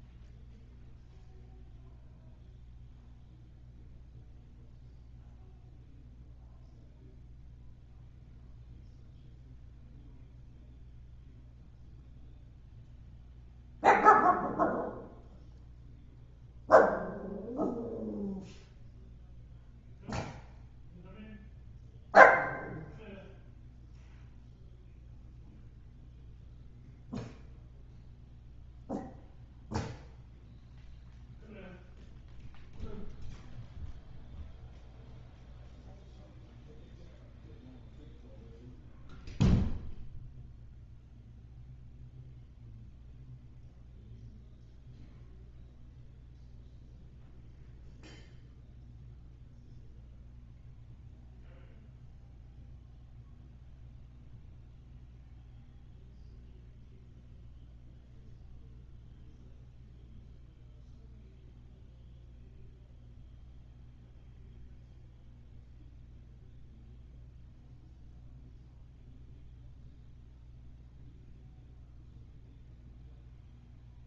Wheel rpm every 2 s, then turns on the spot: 0, 0, 0, 0, 0, 0, 0, 0, 0, 0, 0, 0, 0, 0, 0, 0, 0, 0, 0, 0, 0, 0, 0, 0, 0, 0, 0, 0, 0, 0, 0, 0, 0, 0, 0, 0, 0.
none